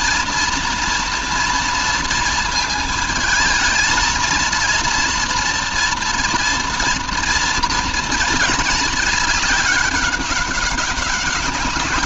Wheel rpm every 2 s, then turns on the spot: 230, 230, 230, 230, 220, 200.
none